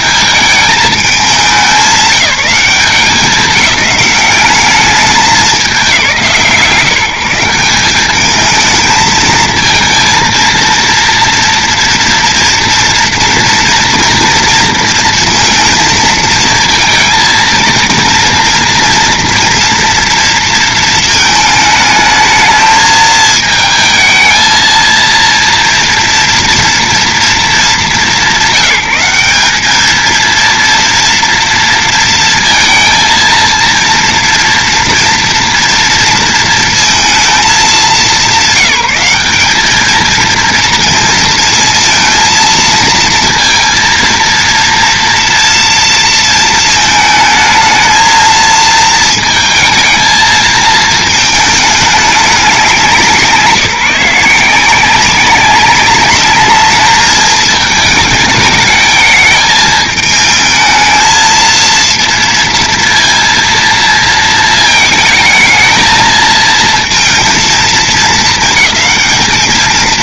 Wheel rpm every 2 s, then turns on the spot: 210, 200, 200, 160, 220, 230, 230, 230, 230, 230, 230, 220, 230, 230, 170, 230, 230, 240, 230, 200, 230, 230, 230, 230, 230, 220, 180, 180, 210, 210, 220, 230, 220, 220, 210.
none